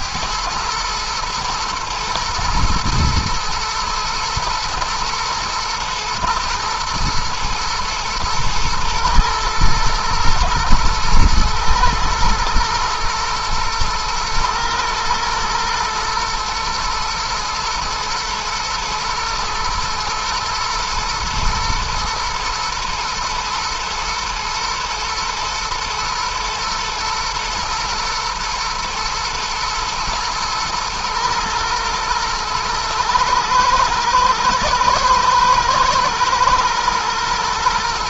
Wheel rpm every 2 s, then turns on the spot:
110, 120, 120, 120, 110, 110, 110, 120, 120, 110, 120, 120, 120, 110, 110, 120, 110, 120, 120.
none